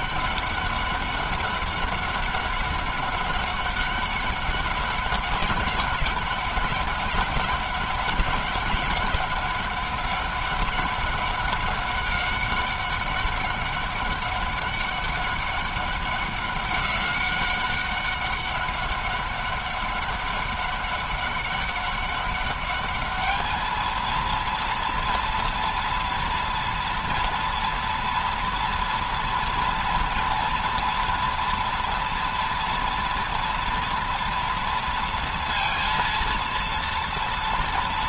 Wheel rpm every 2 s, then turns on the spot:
200, 200, 200, 190, 190, 200, 200, 200, 190, 190, 200, 210, 230, 240, 240, 230, 230, 230, 230.
none